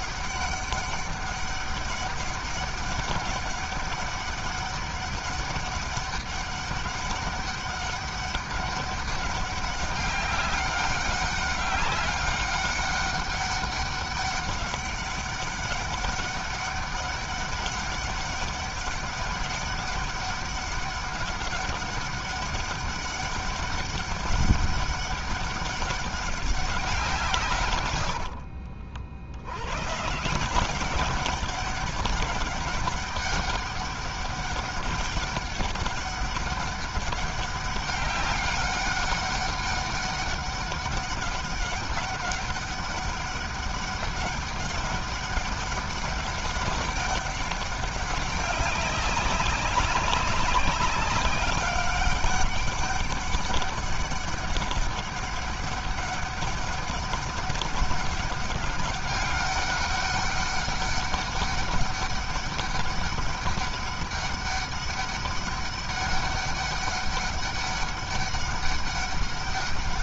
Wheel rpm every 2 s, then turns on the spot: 200, 200, 200, 200, 200, 190, 200, 200, 200, 200, 200, 200, 200, 180, 70, 190, 190, 200, 200, 200, 200, 200, 200, 200, 200, 190, 200, 200, 200, 200, 200, 200, 200, 200, 200.
none